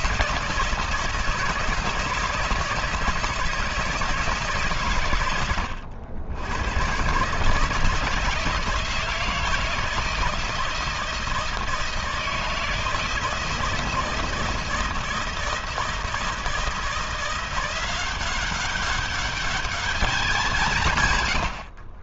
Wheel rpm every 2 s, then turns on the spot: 160, 160, 130, 120, 160, 160, 160, 160, 170, 200, 140.
none